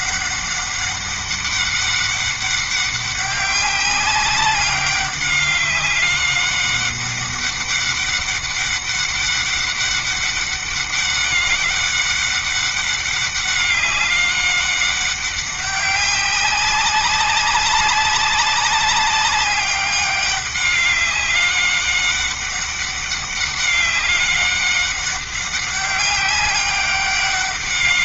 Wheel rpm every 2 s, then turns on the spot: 200, 200, 200, 200, 200, 200, 200, 200, 190, 200, 200, 190, 200, 200.
none